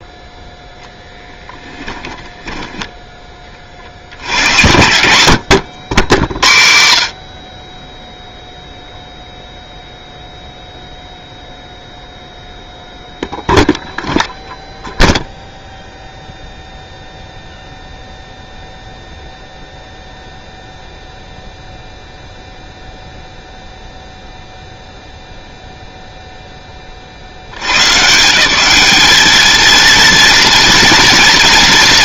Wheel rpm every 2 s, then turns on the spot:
0, 10, 90, 80, 0, 0, 0, 0, 0, 0, 0, 0, 0, 0, 170, 230.
2-4